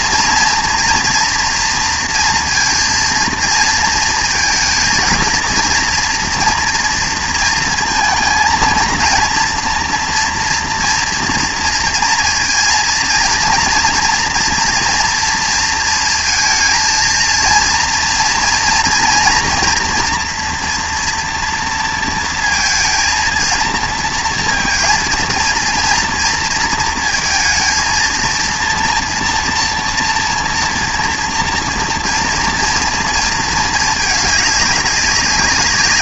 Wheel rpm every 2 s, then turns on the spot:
230, 230, 230, 240, 230, 230, 230, 230, 230, 240, 240, 220, 230, 230, 230, 230, 230, 200.
none